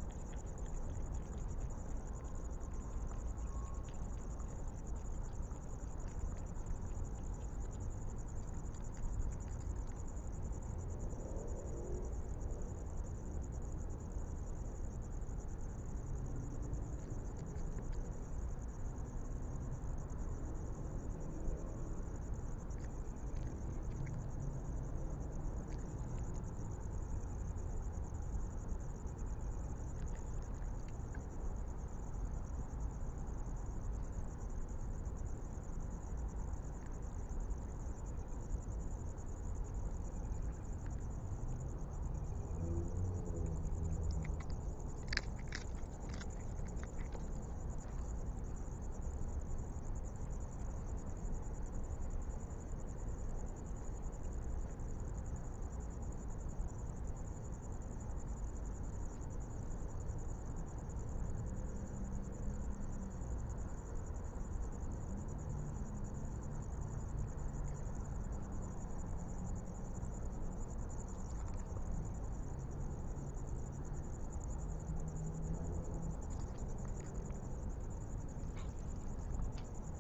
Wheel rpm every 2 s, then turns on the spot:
0, 0, 0, 0, 0, 0, 0, 0, 0, 0, 0, 0, 0, 0, 0, 0, 0, 0, 0, 0, 0, 0, 0, 0, 0, 0, 0, 0, 0, 0, 0, 0, 0, 0, 0, 0, 0, 0, 0, 0.
none